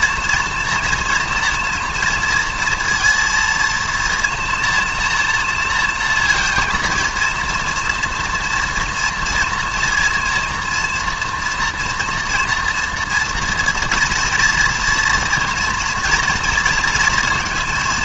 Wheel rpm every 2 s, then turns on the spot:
230, 230, 230, 230, 240, 230, 240, 240, 230.
none